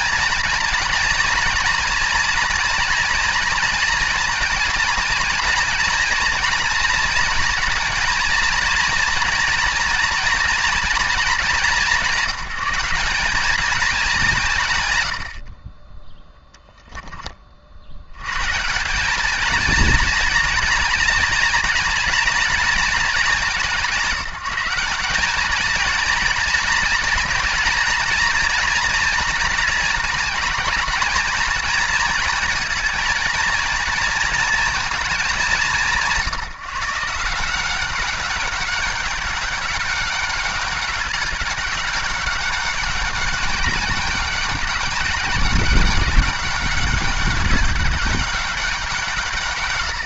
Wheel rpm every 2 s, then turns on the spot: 230, 240, 230, 230, 230, 230, 190, 140, 0, 160, 230, 220, 180, 230, 230, 210, 230, 230, 160, 200, 200, 190, 200, 210, 180.
none